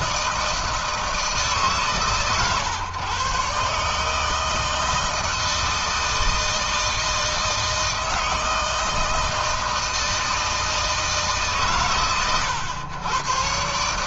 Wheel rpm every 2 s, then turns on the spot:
160, 130, 160, 160, 160, 150, 110.
none